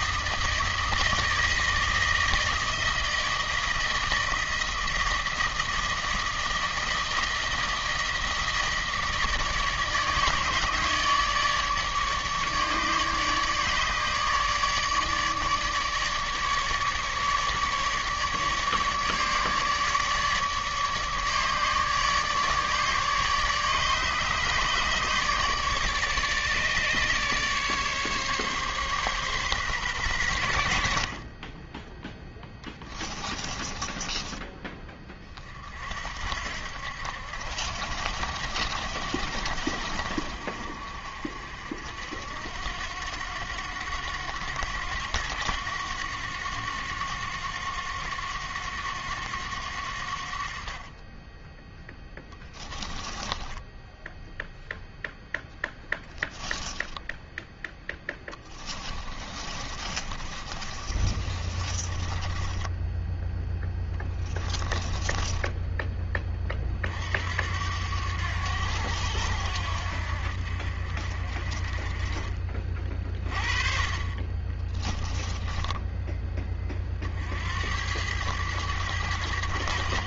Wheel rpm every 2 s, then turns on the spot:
160, 160, 160, 160, 160, 150, 150, 150, 150, 150, 150, 150, 150, 150, 140, 60, 20, 30, 70, 70, 60, 90, 90, 90, 90, 30, 10, 0, 10, 20, 30, 10, 20, 50, 80, 50, 30, 10, 40, 100.
32-34 52-54 58-66 74-76